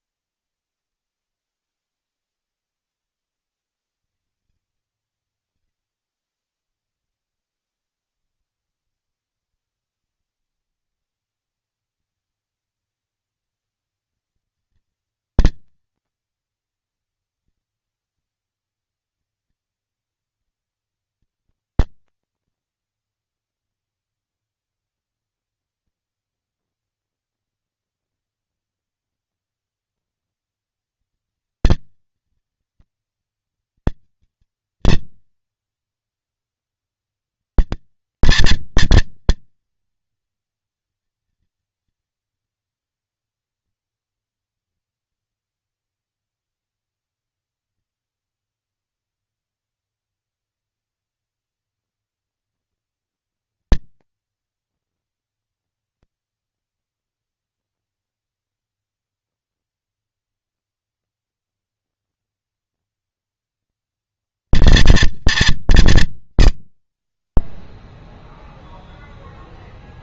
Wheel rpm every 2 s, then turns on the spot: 0, 40, 120, 20, 40, 150, 230, 230, 230, 230, 230, 240, 230, 230, 240, 230, 230, 230, 230, 230, 230, 230, 230, 230, 220, 230, 230, 230, 230, 230, 230, 230, 220, 30, 0.
8-10